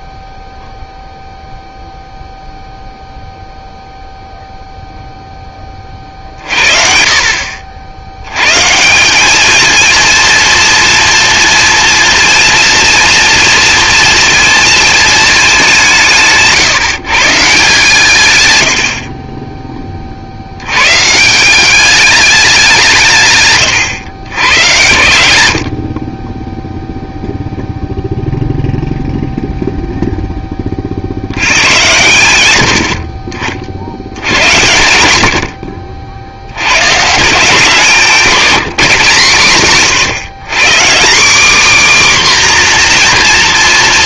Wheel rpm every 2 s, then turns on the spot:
0, 0, 0, 40, 160, 230, 240, 230, 160, 100, 100, 190, 100, 0, 0, 30, 80, 90, 110, 150, 160, 250.
none